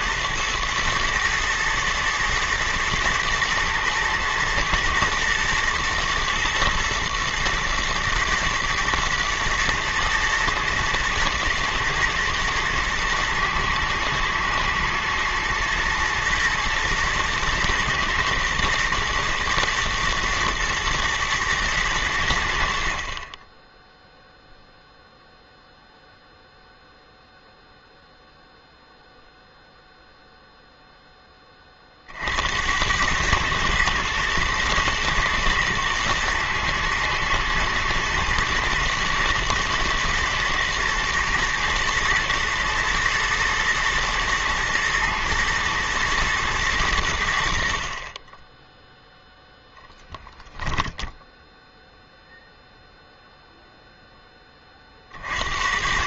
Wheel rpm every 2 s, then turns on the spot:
110, 110, 110, 120, 110, 110, 110, 110, 110, 120, 110, 60, 0, 0, 0, 0, 80, 110, 120, 120, 120, 110, 120, 110, 10, 10, 0, 20.
50-52